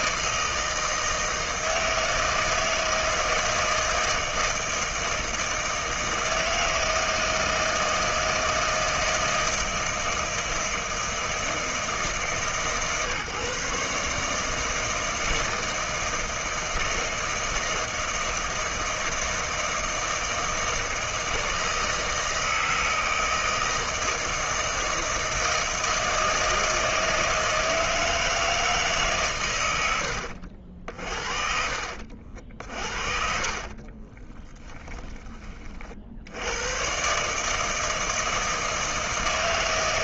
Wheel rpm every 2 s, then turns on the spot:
160, 160, 160, 160, 160, 160, 130, 160, 160, 160, 160, 160, 160, 160, 150, 50, 50, 10, 120, 160.
32-34